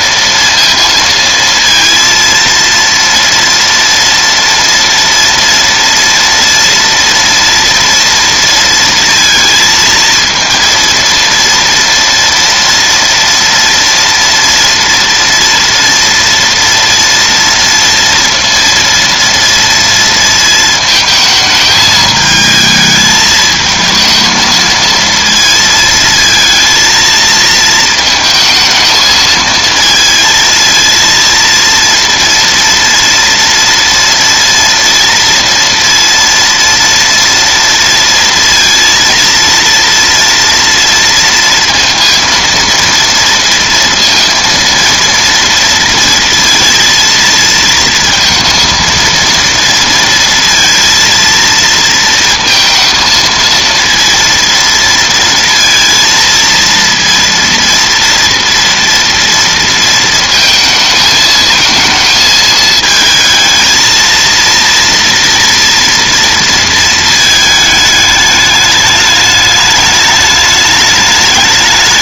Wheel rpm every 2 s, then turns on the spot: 230, 230, 230, 230, 230, 230, 230, 230, 230, 230, 220, 220, 230, 230, 220, 220, 230, 230, 230, 230, 230, 230, 230, 230, 230, 230, 230, 230, 230, 230, 220, 220, 230, 230, 210, 210.
none